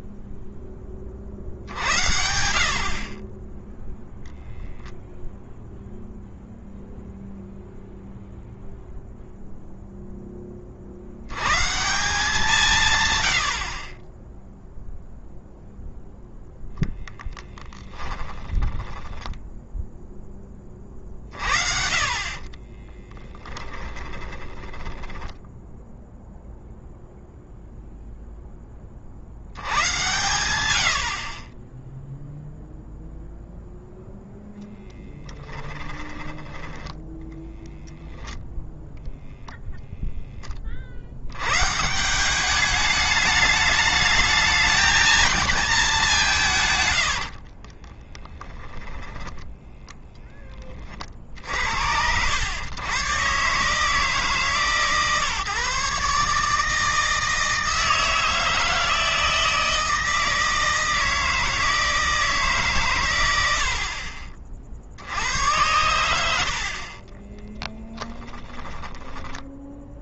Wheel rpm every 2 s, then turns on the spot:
30, 50, 0, 0, 0, 40, 150, 0, 10, 10, 30, 30, 10, 0, 30, 80, 0, 0, 10, 0, 50, 210, 220, 140, 30, 40, 120, 150, 160, 160, 160, 130, 70, 60, 10.
16-20 22-26 46-50 68-70